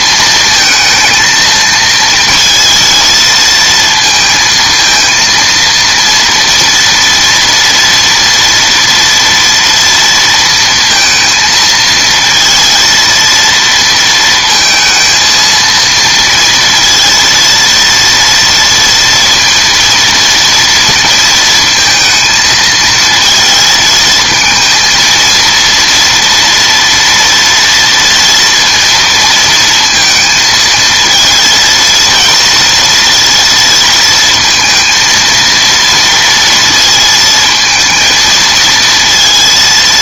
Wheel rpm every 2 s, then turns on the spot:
220, 230, 230, 230, 230, 230, 230, 230, 230, 230, 230, 220, 220, 230, 230, 220, 230, 230, 230, 230.
none